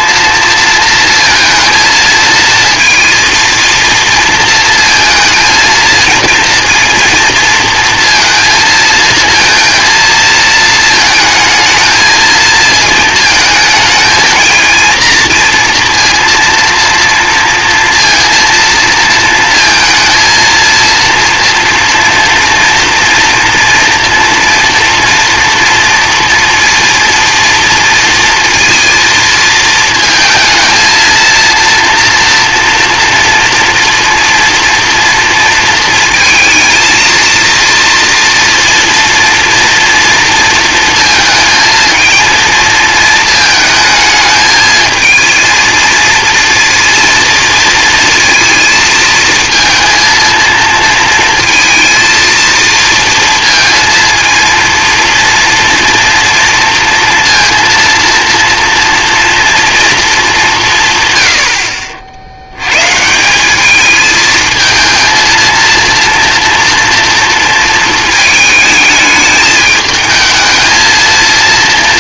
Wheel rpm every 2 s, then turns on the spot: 230, 230, 220, 230, 230, 230, 220, 220, 230, 230, 230, 230, 240, 230, 230, 220, 230, 230, 230, 230, 230, 230, 220, 230, 230, 230, 230, 230, 230, 230, 180, 100, 220, 230, 220, 220.
none